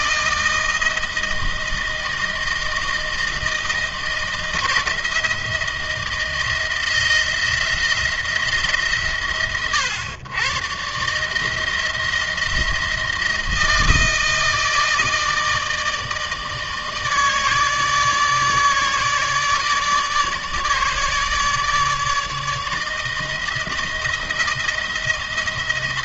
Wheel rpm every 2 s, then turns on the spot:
160, 160, 160, 170, 150, 110, 170, 160, 160, 150, 150, 160, 170.
none